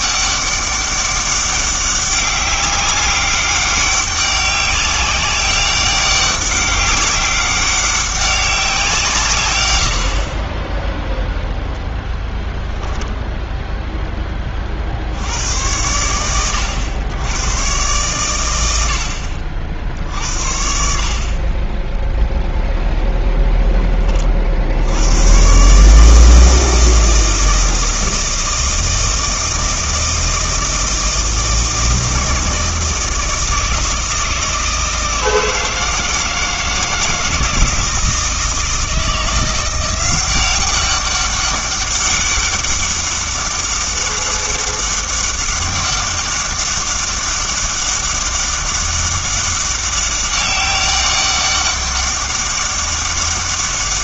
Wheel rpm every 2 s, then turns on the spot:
200, 200, 200, 190, 190, 0, 0, 40, 100, 100, 60, 0, 60, 160, 160, 160, 160, 160, 160, 160, 190, 200, 200, 200, 200, 200, 200.
none